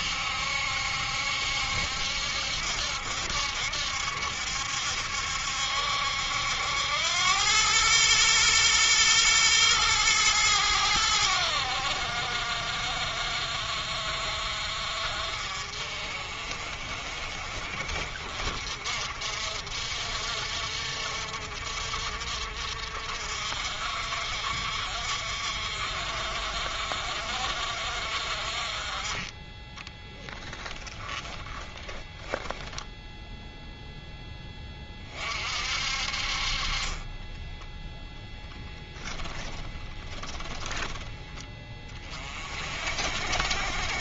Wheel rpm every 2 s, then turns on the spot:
70, 70, 70, 80, 110, 100, 60, 50, 50, 50, 60, 60, 50, 50, 30, 10, 0, 20, 30, 0, 10, 50.
30-32